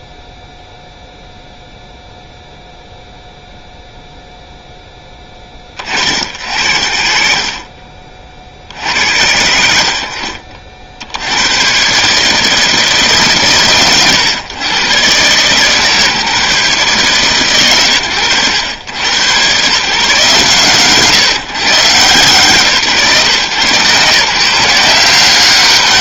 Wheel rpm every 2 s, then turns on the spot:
0, 0, 0, 80, 50, 60, 150, 110, 140, 90, 130, 140, 170.
none